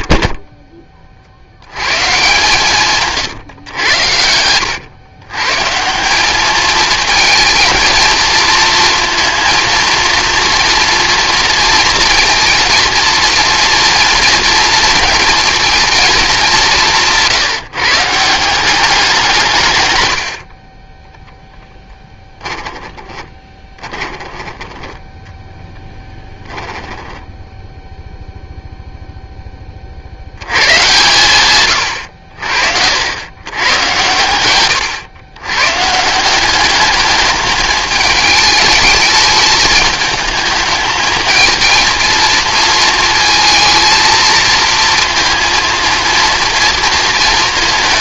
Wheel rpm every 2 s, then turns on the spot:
30, 140, 100, 220, 230, 230, 230, 230, 180, 180, 20, 20, 10, 10, 0, 120, 70, 110, 210, 210, 220, 230, 230, 230.
22-24